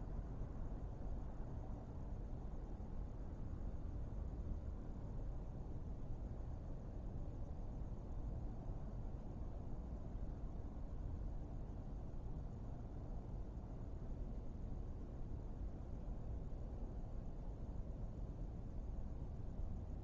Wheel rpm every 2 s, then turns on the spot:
0, 0, 0, 0, 0, 0, 0, 0, 0, 0.
none